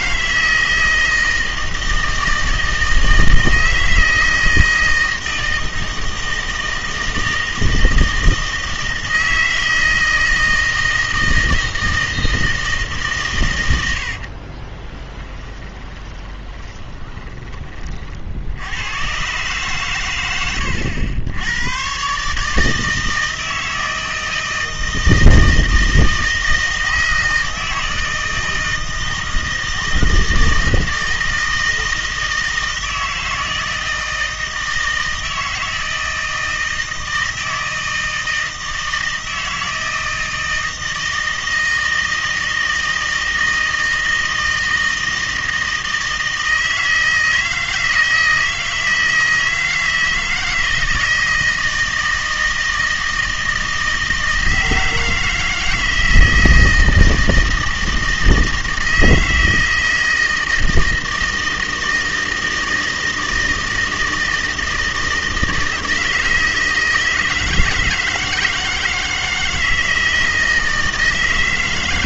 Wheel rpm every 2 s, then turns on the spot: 160, 160, 160, 160, 160, 160, 160, 40, 20, 80, 100, 160, 160, 160, 160, 160, 160, 160, 160, 160, 160, 160, 160, 160, 160, 160, 160, 160, 160, 160, 160, 160, 160, 160, 160, 160.
14-18